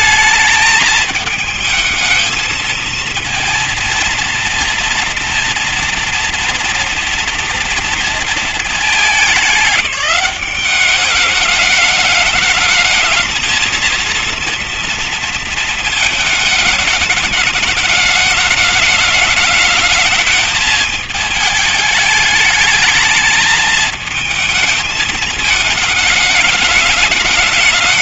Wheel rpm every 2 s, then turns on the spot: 220, 220, 240, 230, 220, 200, 220, 230, 210, 210, 220, 210, 220, 200.
none